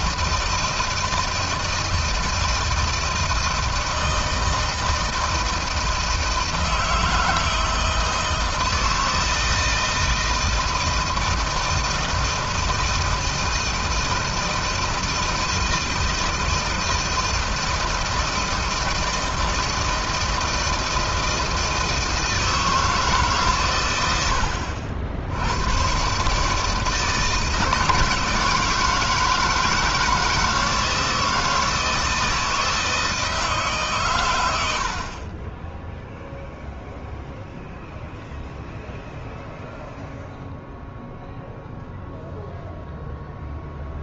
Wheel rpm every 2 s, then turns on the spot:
160, 160, 160, 160, 160, 160, 160, 160, 160, 160, 160, 160, 60, 150, 160, 160, 160, 90, 0, 0, 0, 0.
none